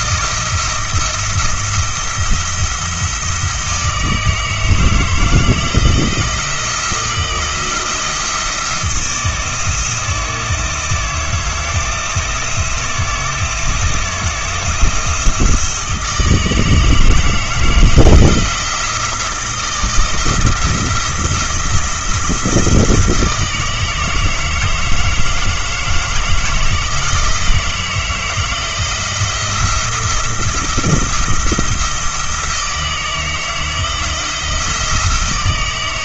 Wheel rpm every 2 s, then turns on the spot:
170, 170, 160, 170, 160, 160, 160, 160, 160, 170, 170, 160, 160, 160, 160, 170, 160, 160.
none